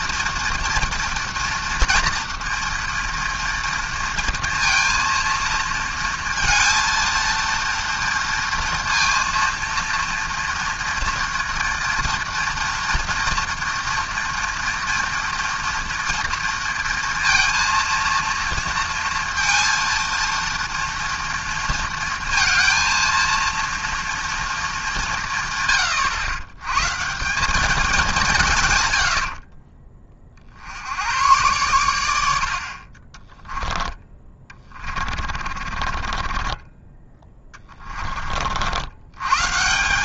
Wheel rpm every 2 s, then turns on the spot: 230, 230, 230, 230, 230, 230, 240, 240, 230, 230, 230, 230, 190, 140, 110, 70, 40, 30, 20, 100.
34-38